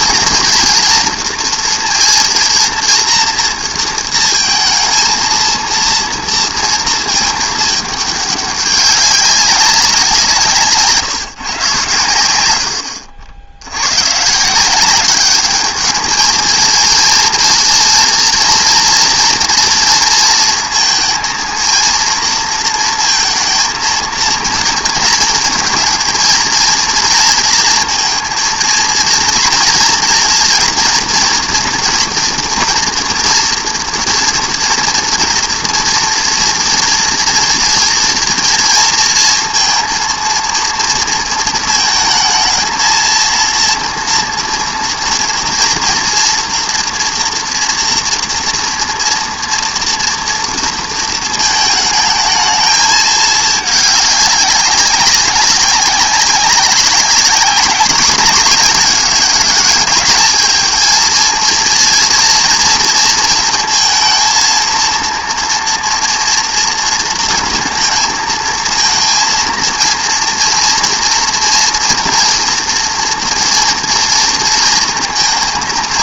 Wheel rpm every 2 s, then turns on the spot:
230, 230, 230, 220, 200, 160, 70, 200, 230, 240, 230, 230, 230, 230, 230, 240, 230, 240, 230, 230, 230, 230, 230, 240, 230, 230, 220, 190, 200, 190, 220, 230, 230, 230, 230, 230, 230, 230.
none